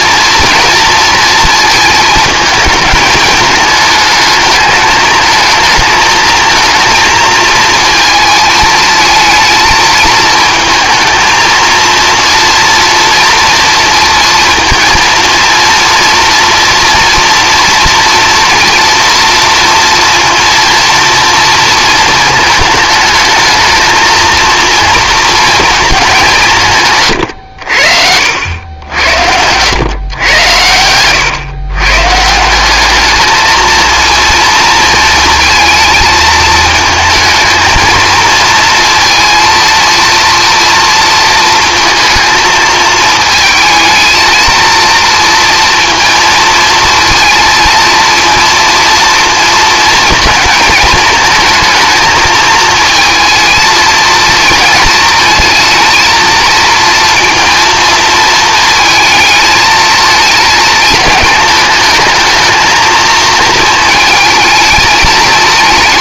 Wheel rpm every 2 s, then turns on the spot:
230, 220, 220, 220, 220, 220, 230, 230, 230, 230, 230, 220, 230, 140, 90, 100, 200, 230, 220, 230, 230, 220, 230, 230, 230, 230, 230, 220, 230, 220, 220, 220, 220.
none